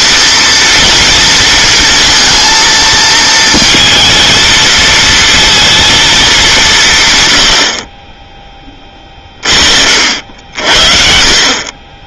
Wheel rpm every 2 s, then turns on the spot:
230, 230, 220, 170, 20, 60.
none